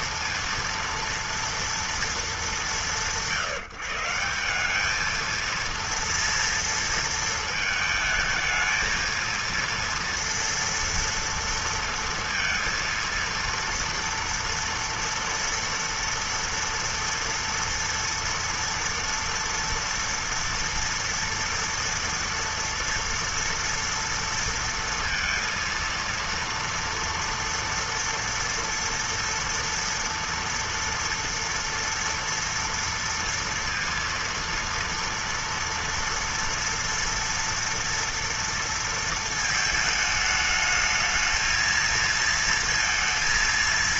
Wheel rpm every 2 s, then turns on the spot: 230, 210, 170, 230, 220, 230, 230, 230, 230, 230, 230, 230, 230, 230, 230, 230, 230, 230, 230, 230, 210, 230.
none